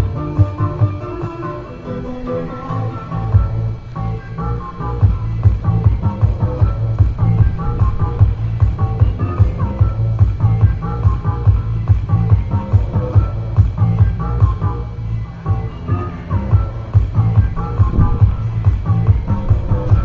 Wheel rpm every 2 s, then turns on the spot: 0, 0, 0, 0, 0, 0, 0, 0, 0, 0.
none